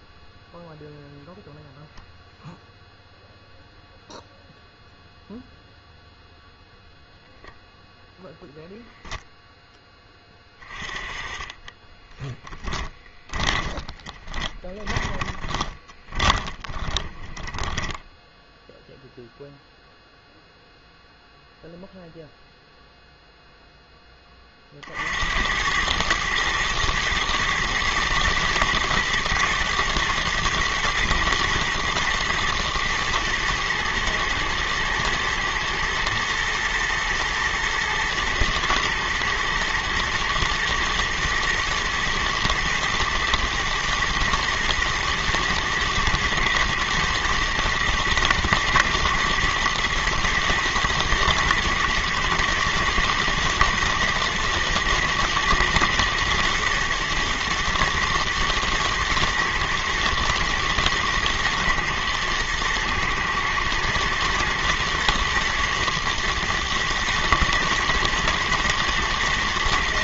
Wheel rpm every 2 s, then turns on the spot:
0, 0, 0, 0, 0, 20, 10, 20, 10, 0, 0, 0, 40, 110, 110, 110, 110, 110, 120, 120, 110, 120, 120, 110, 110, 110, 120, 110, 110, 110, 110, 110, 120, 110, 110.
12-18